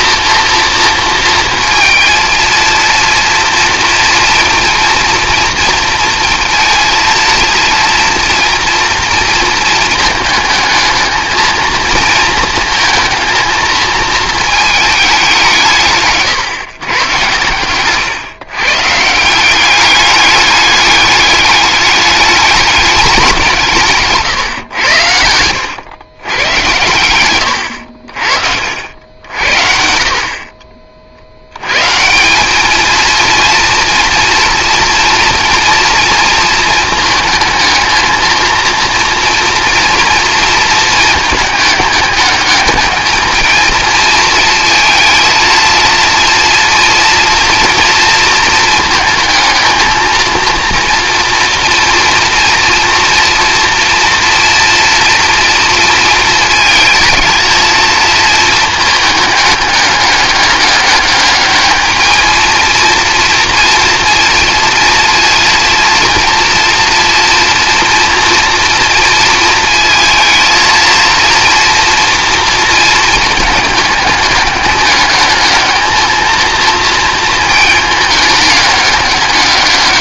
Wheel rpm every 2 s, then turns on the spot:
230, 230, 230, 230, 230, 220, 230, 210, 130, 150, 200, 200, 110, 100, 70, 50, 220, 230, 230, 230, 220, 210, 230, 230, 220, 230, 240, 230, 220, 220, 210, 230, 230, 230, 230, 230, 220, 200, 230, 200.
none